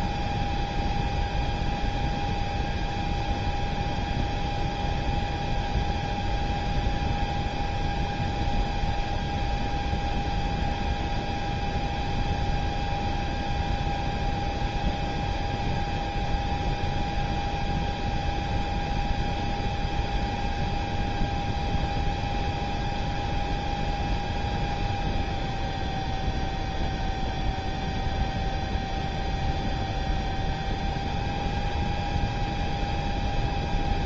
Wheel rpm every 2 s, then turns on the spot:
0, 0, 0, 0, 0, 0, 0, 0, 0, 0, 0, 0, 0, 0, 0, 0, 0.
none